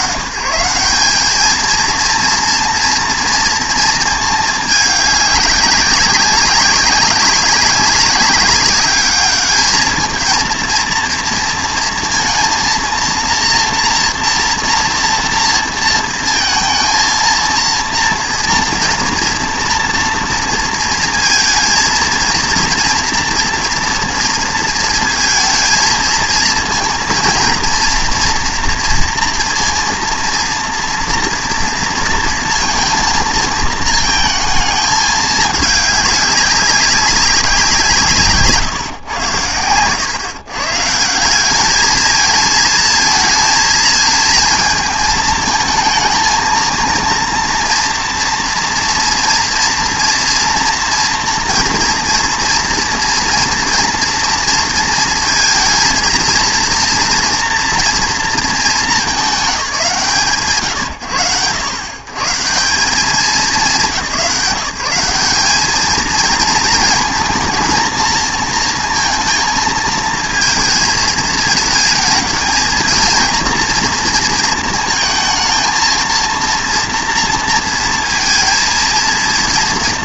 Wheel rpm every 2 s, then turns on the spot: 130, 240, 210, 190, 200, 230, 230, 230, 230, 240, 230, 230, 230, 230, 240, 230, 230, 220, 200, 140, 140, 220, 220, 230, 230, 230, 230, 230, 230, 220, 120, 140, 190, 230, 230, 220, 220, 220, 230, 230.
none